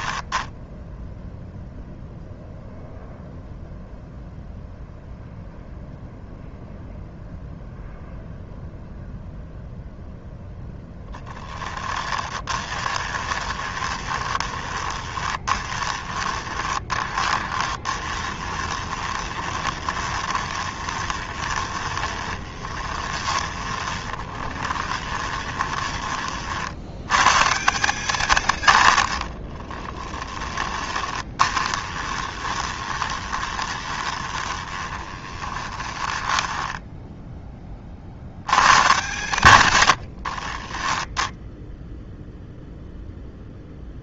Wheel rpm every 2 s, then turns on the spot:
0, 0, 0, 0, 0, 10, 20, 20, 20, 20, 20, 20, 20, 80, 100, 20, 20, 20, 10, 130, 20, 0.
12-26 28-38 40-42